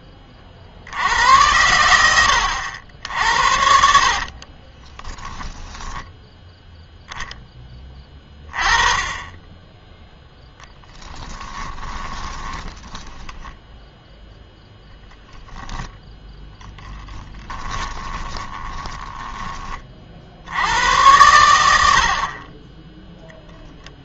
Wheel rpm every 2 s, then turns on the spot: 70, 70, 20, 0, 20, 20, 20, 0, 10, 10, 90, 20.
4-6 10-14 16-20